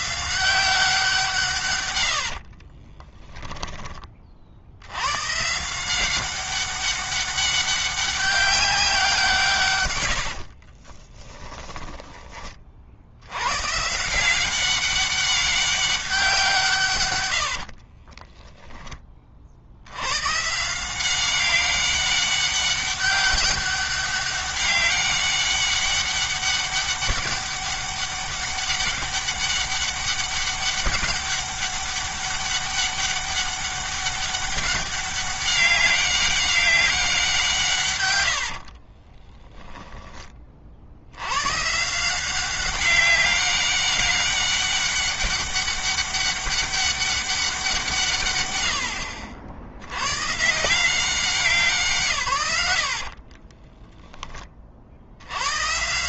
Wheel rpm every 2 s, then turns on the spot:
170, 20, 100, 200, 190, 40, 60, 190, 130, 20, 170, 200, 200, 200, 200, 200, 200, 200, 190, 50, 70, 190, 200, 200, 80, 180, 70, 60.
2-4 10-12 38-40 52-54